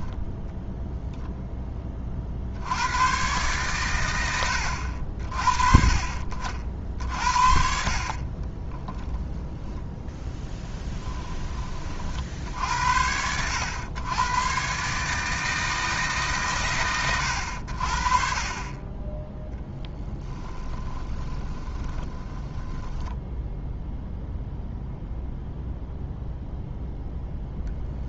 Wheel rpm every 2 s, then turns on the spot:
10, 90, 70, 50, 10, 10, 70, 130, 120, 20, 20, 10, 0, 0.
8-10 20-24